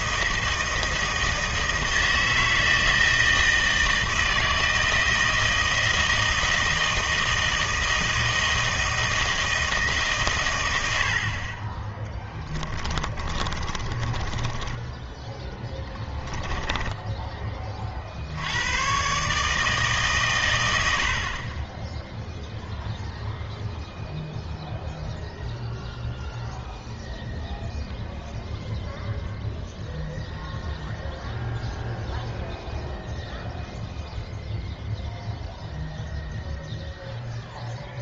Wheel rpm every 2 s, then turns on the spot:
160, 160, 160, 160, 160, 80, 20, 10, 10, 110, 90, 0, 0, 0, 0, 0, 0, 0, 0.
12-18